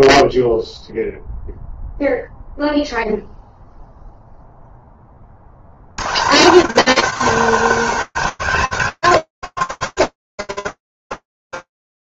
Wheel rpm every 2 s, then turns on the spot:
0, 0, 30, 250, 240, 210.
none